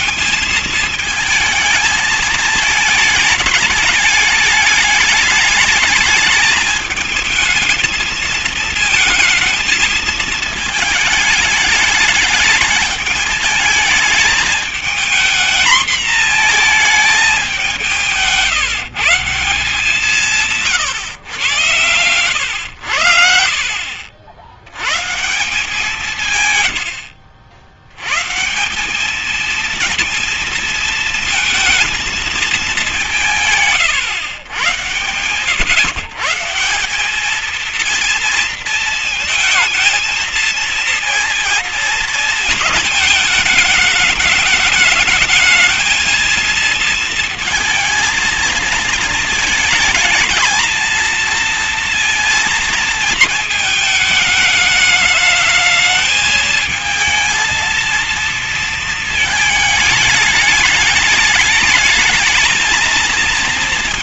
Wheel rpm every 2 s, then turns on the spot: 220, 220, 210, 210, 220, 220, 210, 220, 220, 150, 140, 100, 90, 110, 170, 230, 200, 120, 170, 230, 230, 220, 210, 230, 230, 220, 230, 220, 220, 230, 210, 220.
none